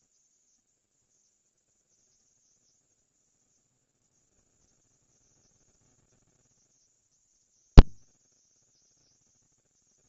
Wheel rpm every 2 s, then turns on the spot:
0, 0, 0, 0, 0.
none